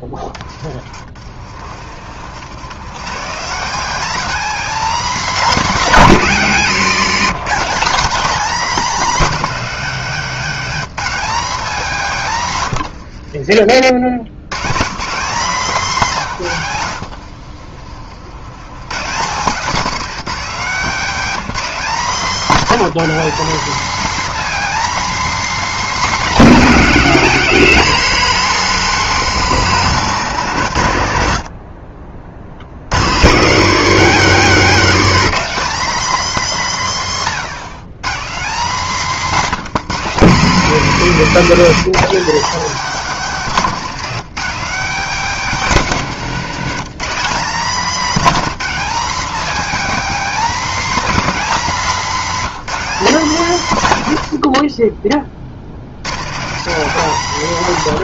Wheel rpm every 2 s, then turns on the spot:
30, 130, 260, 210, 240, 220, 110, 130, 130, 130, 220, 230, 270, 220, 190, 140, 110, 230, 180, 200, 200, 230, 220, 210, 240, 270, 220, 50, 190.
12-14 16-18